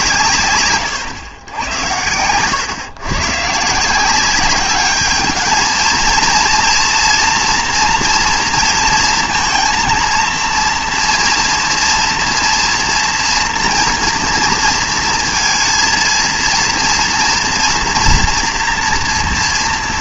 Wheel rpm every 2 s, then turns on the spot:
140, 120, 200, 230, 230, 230, 230, 230, 230, 230.
none